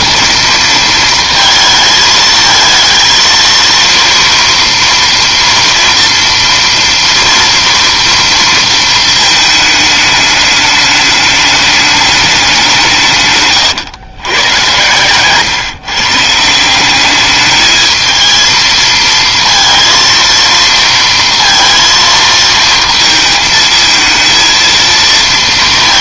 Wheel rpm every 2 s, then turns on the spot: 230, 220, 230, 230, 230, 210, 180, 120, 180, 220, 230, 230, 230.
none